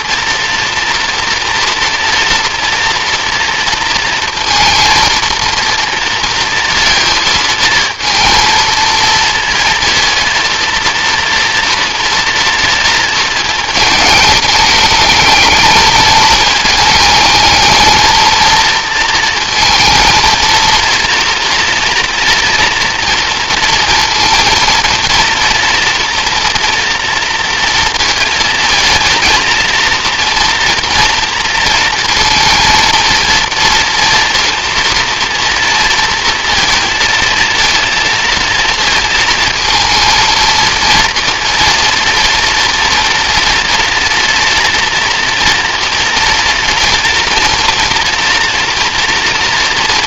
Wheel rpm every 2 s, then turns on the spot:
240, 240, 230, 230, 230, 230, 230, 210, 220, 230, 230, 240, 230, 230, 220, 230, 230, 230, 230, 230, 230, 230, 230, 230, 240.
none